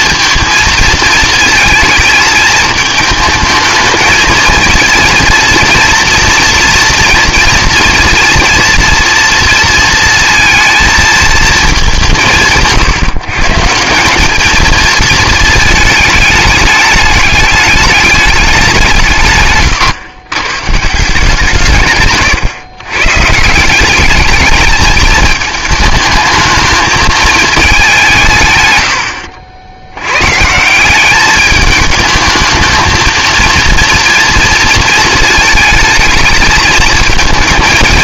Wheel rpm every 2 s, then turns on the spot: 230, 220, 220, 230, 230, 220, 150, 220, 210, 180, 140, 130, 210, 220, 110, 160, 220, 230, 220.
none